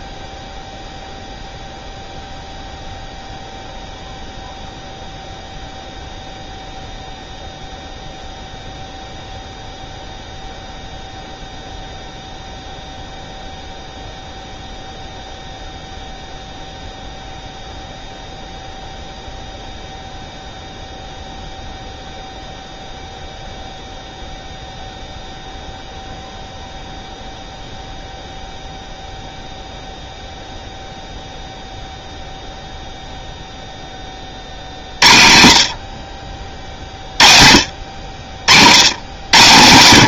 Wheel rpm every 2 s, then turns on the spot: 0, 0, 0, 0, 0, 0, 0, 0, 0, 0, 0, 0, 0, 0, 0, 0, 0, 60, 50, 90.
none